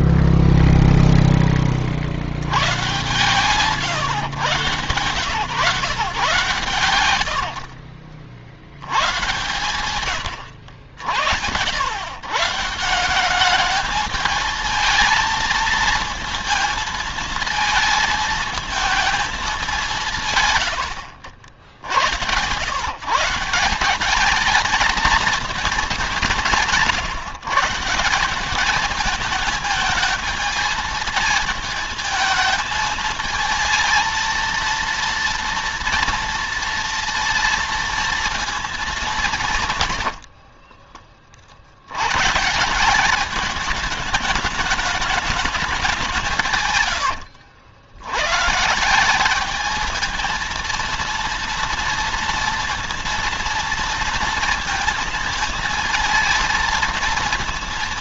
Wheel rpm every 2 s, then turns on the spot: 0, 110, 130, 110, 100, 80, 170, 220, 220, 220, 90, 120, 220, 140, 210, 220, 220, 230, 230, 200, 30, 170, 210, 120, 170, 230, 230, 230, 230.
40-42